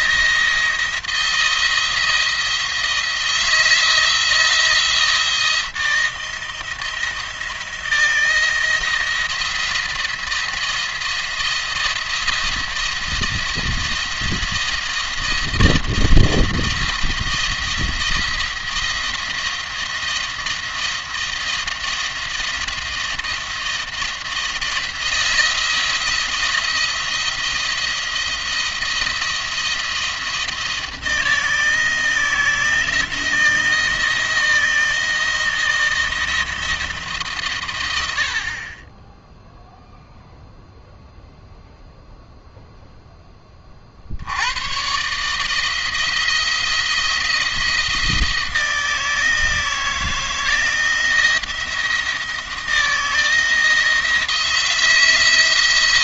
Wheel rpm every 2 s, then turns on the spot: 170, 170, 170, 170, 160, 170, 170, 170, 170, 170, 170, 170, 170, 170, 170, 170, 160, 170, 160, 30, 0, 0, 110, 170, 160, 170, 160, 160.
none